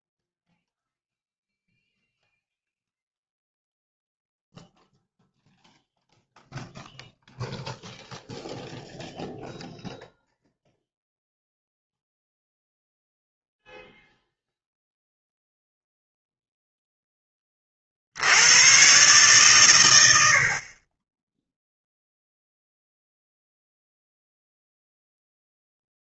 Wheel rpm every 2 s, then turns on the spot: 0, 0, 0, 0, 0, 0, 0, 0, 0, 100, 40, 0, 0.
none